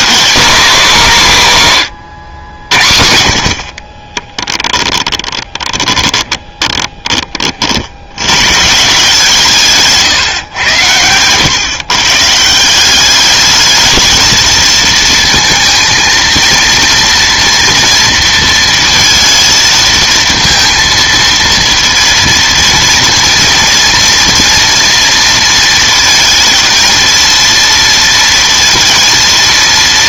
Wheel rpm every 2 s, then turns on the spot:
230, 80, 20, 20, 140, 120, 180, 220, 230, 230, 230, 230, 230, 230, 230.
4-8